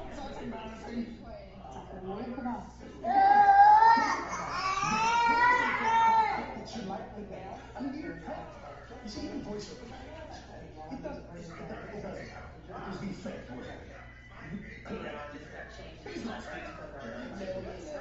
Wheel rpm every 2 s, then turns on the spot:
0, 0, 0, 0, 0, 0, 0, 0, 0.
none